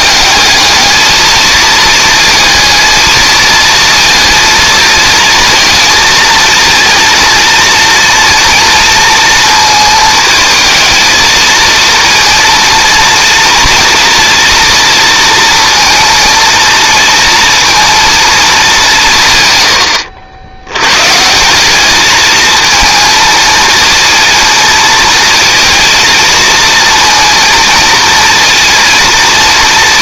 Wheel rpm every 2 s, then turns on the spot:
220, 230, 230, 230, 240, 220, 230, 240, 230, 190, 100, 220, 220, 230, 230.
none